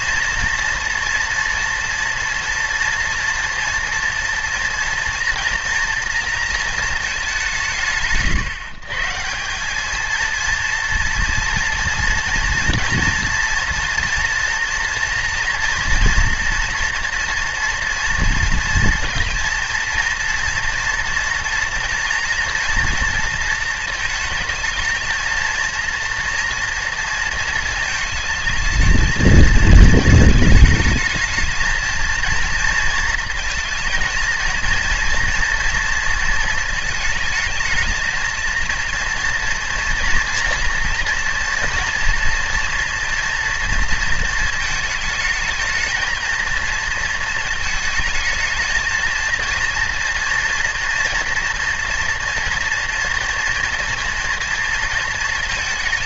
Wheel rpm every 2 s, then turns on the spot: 230, 230, 230, 220, 150, 230, 230, 230, 240, 230, 230, 230, 230, 230, 220, 220, 230, 230, 220, 230, 230, 230, 220, 230, 220, 240, 230, 230.
none